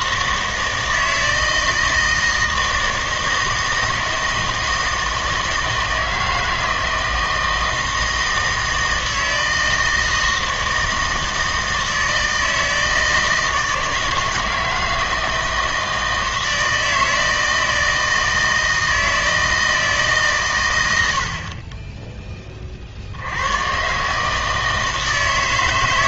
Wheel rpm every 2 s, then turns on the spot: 160, 160, 160, 160, 160, 160, 160, 160, 160, 160, 110, 30, 160.
none